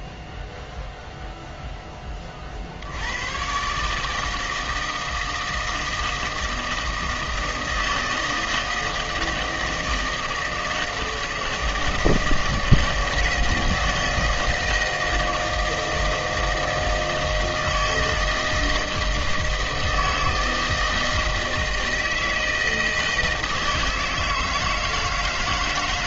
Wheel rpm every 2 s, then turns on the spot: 0, 50, 160, 160, 160, 160, 160, 160, 160, 160, 160, 160, 160.
none